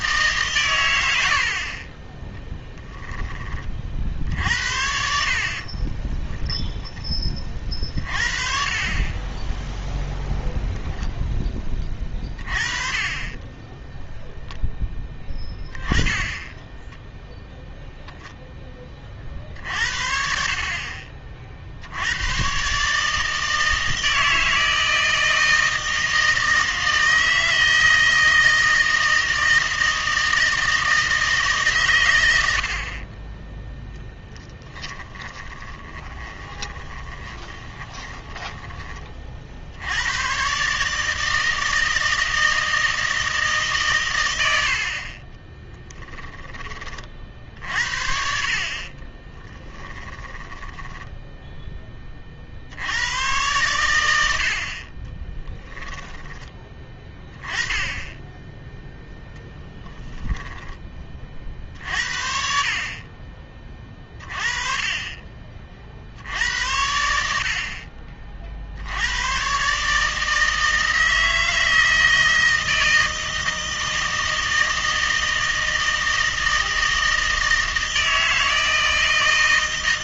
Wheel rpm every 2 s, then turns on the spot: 120, 10, 70, 10, 30, 0, 30, 0, 10, 20, 50, 130, 160, 160, 160, 160, 60, 10, 20, 20, 130, 160, 70, 20, 50, 10, 70, 50, 10, 10, 20, 50, 30, 90, 60, 160, 160, 160, 160, 160.
2-4 12-14 16-18 34-38 50-52 60-62